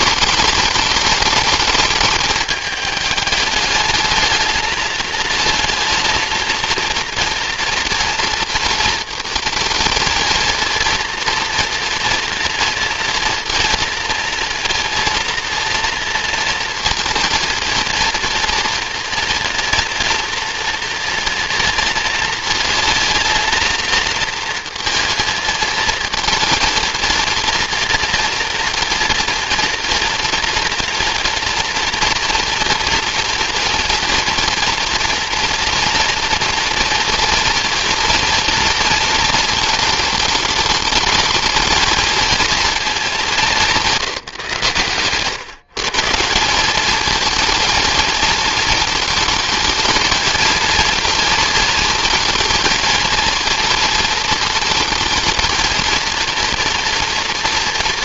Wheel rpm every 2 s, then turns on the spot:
210, 210, 220, 230, 230, 230, 240, 230, 230, 230, 230, 220, 230, 230, 240, 230, 240, 230, 230, 230, 220, 220, 130, 200, 220, 230, 230, 220, 230.
none